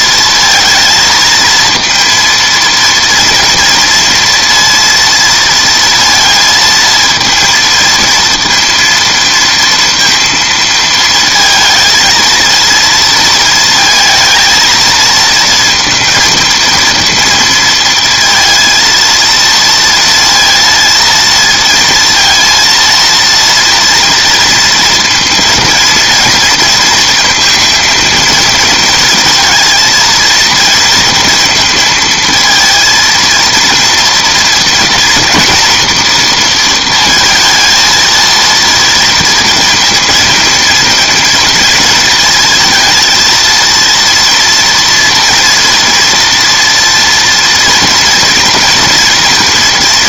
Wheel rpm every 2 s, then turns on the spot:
230, 230, 230, 230, 230, 230, 230, 220, 230, 230, 230, 230, 230, 230, 230, 230, 230, 230, 230, 230, 220, 220, 230, 230, 230.
none